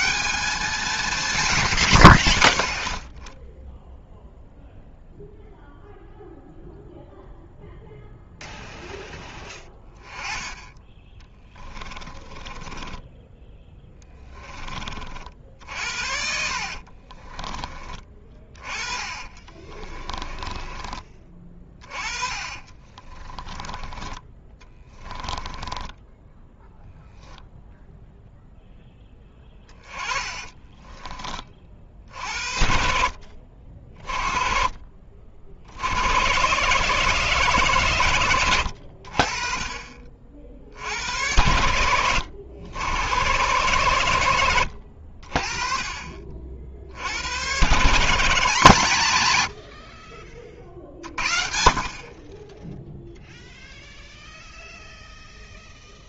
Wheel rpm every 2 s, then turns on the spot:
170, 20, 0, 0, 0, 10, 10, 40, 40, 20, 20, 40, 20, 10, 10, 20, 50, 40, 150, 80, 70, 90, 70, 70, 160, 50, 0, 0.
12-14 16-26 30-32